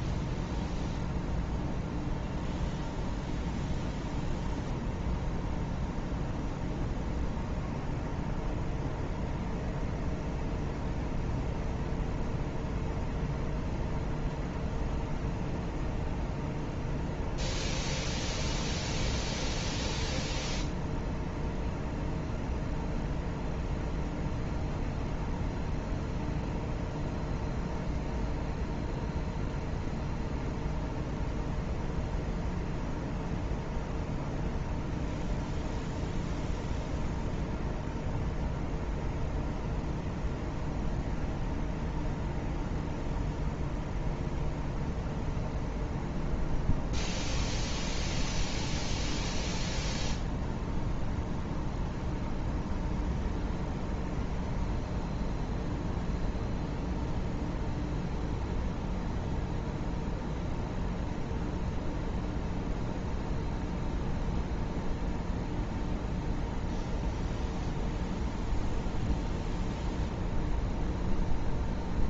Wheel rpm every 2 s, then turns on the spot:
0, 0, 0, 0, 0, 0, 0, 0, 0, 0, 0, 0, 0, 0, 0, 0, 0, 0, 0, 0, 0, 0, 0, 0, 0, 0, 0, 0, 0, 0, 0, 0, 0, 0, 0, 0.
none